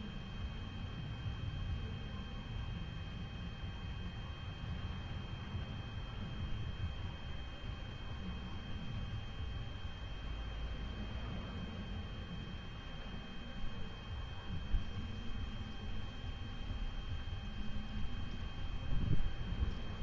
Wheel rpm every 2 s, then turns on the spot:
0, 0, 0, 0, 0, 0, 0, 0, 0, 0.
none